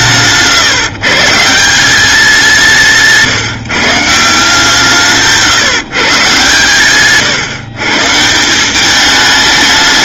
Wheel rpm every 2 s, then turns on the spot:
130, 170, 160, 130, 200.
2-4 6-8